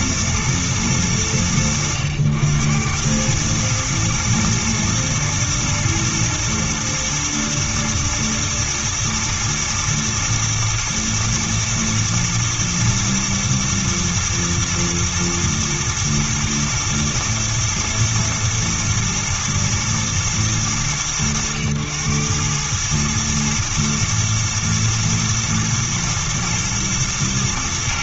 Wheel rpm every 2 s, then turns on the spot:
110, 90, 110, 110, 110, 110, 110, 110, 110, 110, 100, 100, 110, 110.
none